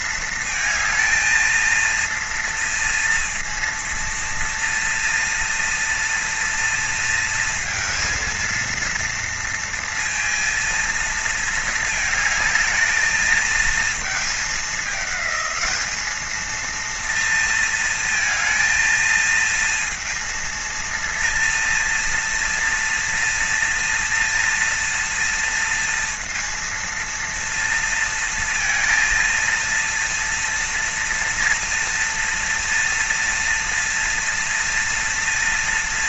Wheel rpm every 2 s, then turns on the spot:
230, 230, 230, 230, 230, 230, 220, 210, 230, 230, 230, 230, 230, 230, 230, 230, 230, 230.
none